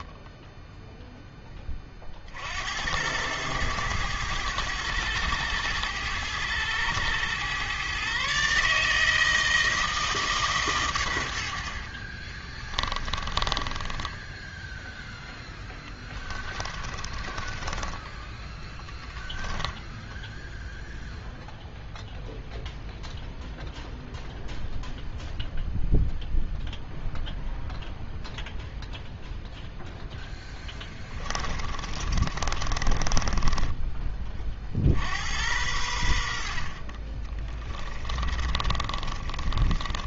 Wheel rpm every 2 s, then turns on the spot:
0, 70, 100, 100, 140, 140, 20, 10, 20, 10, 0, 0, 0, 0, 0, 10, 30, 30, 60, 30.
12-20 30-34 38-40